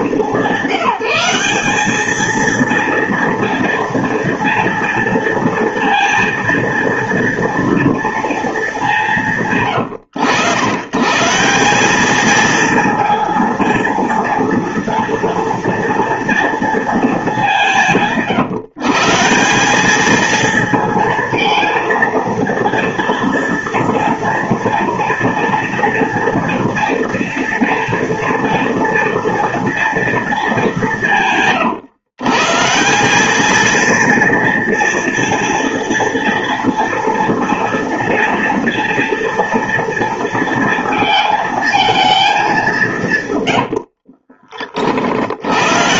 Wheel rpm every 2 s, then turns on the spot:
190, 230, 230, 230, 180, 140, 230, 230, 210, 160, 230, 230, 230, 230, 240, 180, 190, 230, 230, 230, 220, 150, 60.
none